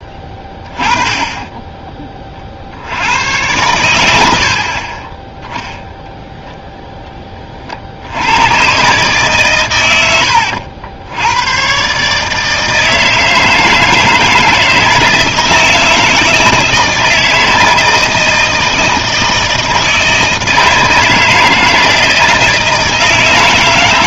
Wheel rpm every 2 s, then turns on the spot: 20, 70, 40, 0, 110, 80, 160, 160, 160, 160, 160, 160.
0-2